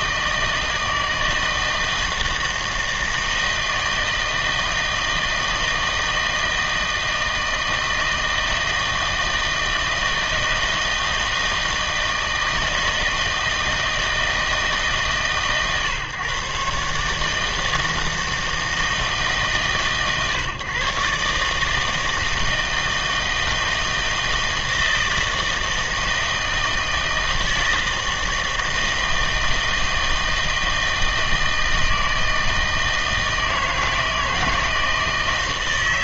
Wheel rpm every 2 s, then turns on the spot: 160, 160, 160, 160, 160, 160, 160, 160, 140, 160, 130, 160, 160, 160, 160, 160, 160, 160.
none